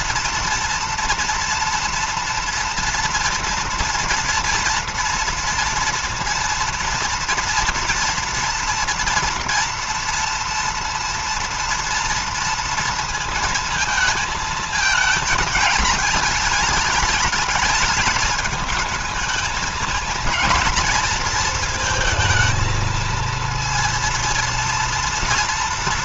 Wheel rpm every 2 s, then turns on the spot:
230, 230, 230, 230, 240, 230, 230, 220, 210, 220, 230, 220, 230.
none